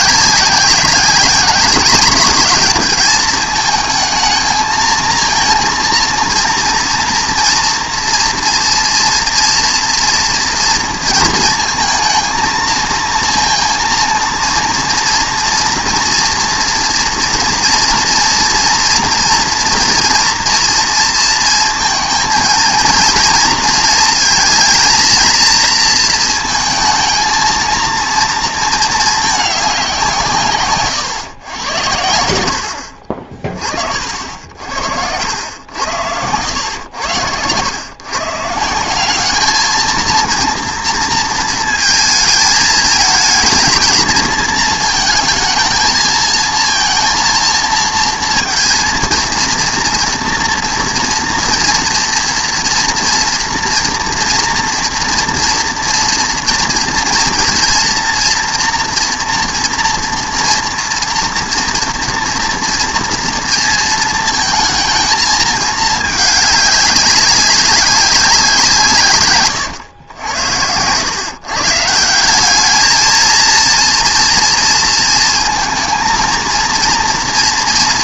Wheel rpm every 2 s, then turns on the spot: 190, 210, 220, 230, 230, 230, 230, 230, 230, 230, 230, 230, 230, 230, 230, 140, 80, 70, 90, 180, 230, 220, 230, 230, 230, 230, 230, 230, 230, 230, 240, 240, 220, 200, 160, 90, 210, 230, 230.
30-32